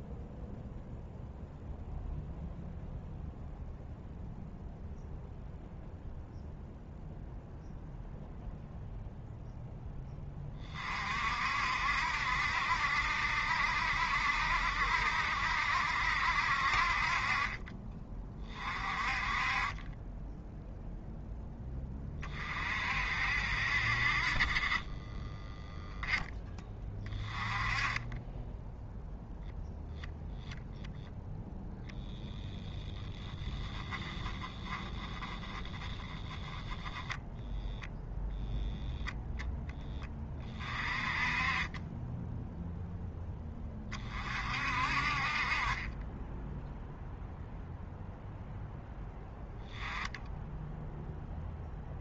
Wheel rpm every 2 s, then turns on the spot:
0, 0, 0, 0, 0, 40, 70, 70, 40, 30, 0, 50, 20, 20, 0, 0, 0, 10, 10, 10, 30, 0, 50, 0, 10, 0.
none